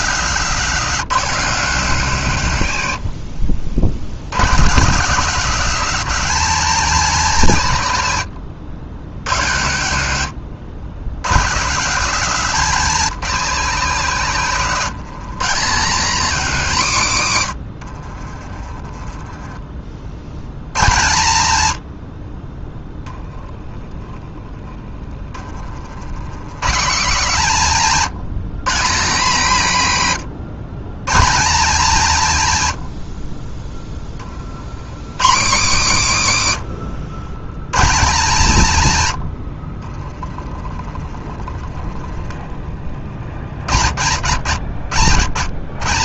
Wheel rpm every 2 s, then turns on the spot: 160, 100, 150, 180, 90, 100, 170, 130, 150, 20, 110, 10, 20, 160, 170, 140, 90, 100, 110, 130, 20, 40, 110.
18-20 24-26 36-38 40-42